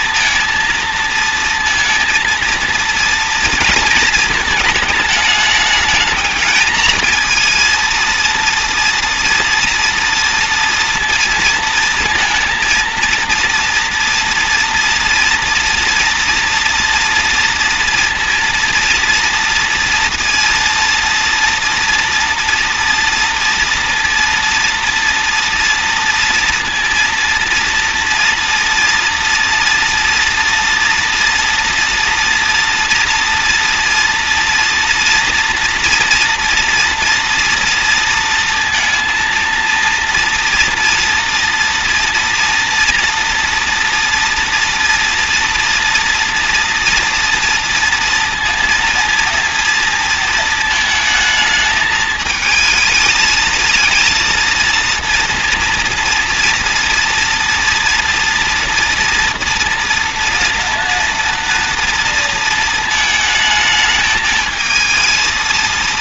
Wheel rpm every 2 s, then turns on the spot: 230, 230, 220, 220, 230, 230, 230, 230, 230, 230, 230, 230, 230, 230, 230, 240, 230, 230, 230, 230, 230, 240, 230, 240, 240, 230, 220, 230, 230, 230, 230, 230, 230.
none